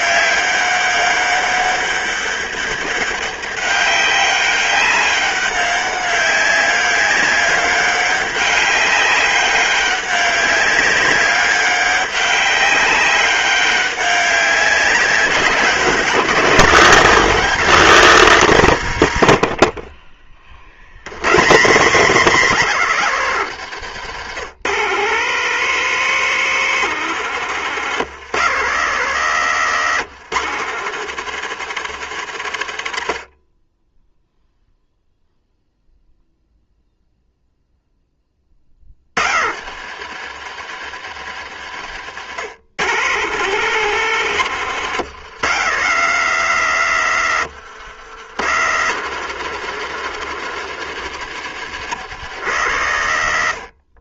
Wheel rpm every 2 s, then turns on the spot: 200, 200, 200, 200, 200, 190, 200, 180, 200, 130, 110, 160, 150, 180, 150, 160, 70, 0, 0, 60, 100, 140, 150, 140, 140, 150, 110.
none